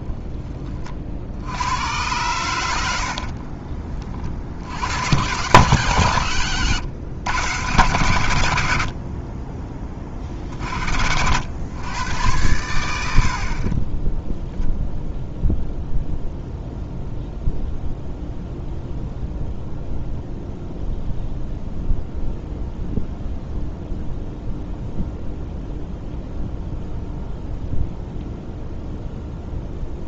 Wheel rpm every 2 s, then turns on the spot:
40, 80, 90, 120, 60, 60, 80, 0, 0, 0, 0, 0, 0, 0, 0.
2-4